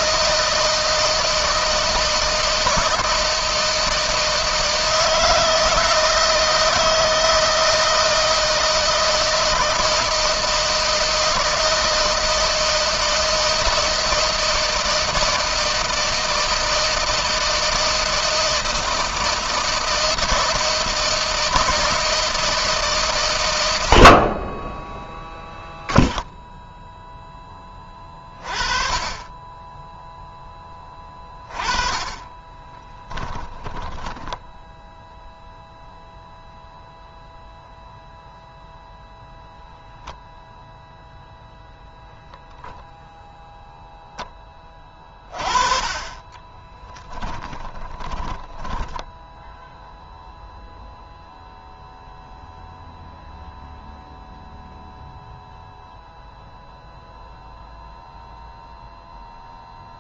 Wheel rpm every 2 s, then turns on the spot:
160, 160, 160, 160, 160, 160, 160, 160, 160, 160, 160, 140, 10, 10, 20, 20, 20, 0, 0, 0, 0, 0, 20, 20, 10, 0, 0, 0, 0, 0.
32-34 44-50